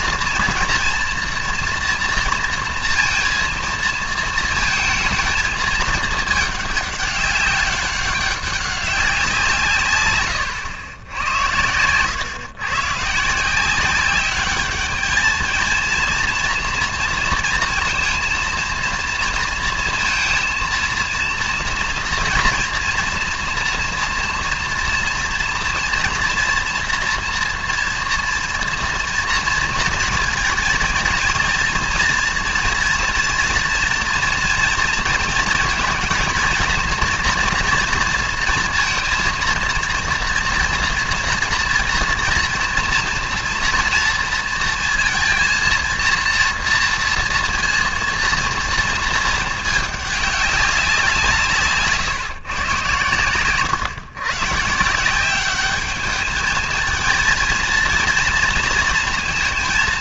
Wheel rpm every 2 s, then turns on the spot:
230, 230, 230, 200, 190, 110, 120, 200, 230, 230, 230, 240, 230, 230, 240, 230, 230, 230, 230, 230, 230, 230, 230, 230, 230, 190, 120, 160, 220, 230.
none